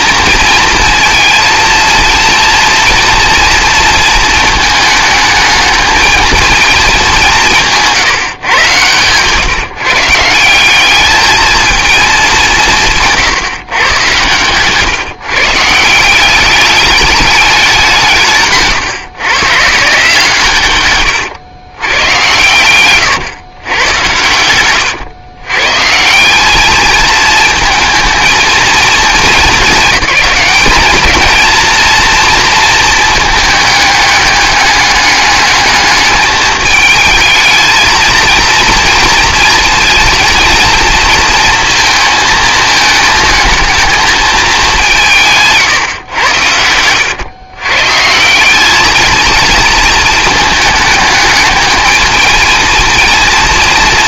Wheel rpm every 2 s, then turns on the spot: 230, 230, 220, 220, 130, 190, 160, 140, 200, 130, 120, 120, 120, 220, 230, 210, 230, 210, 220, 220, 220, 220, 190, 90, 210, 210, 230.
22-24